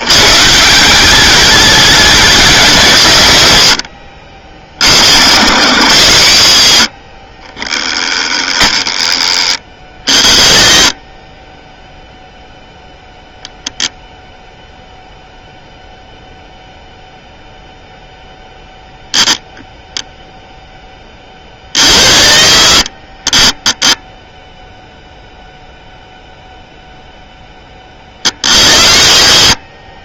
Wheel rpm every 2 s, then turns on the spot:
150, 190, 40, 90, 10, 20, 0, 0, 0, 0, 0, 30, 0, 0, 50.
none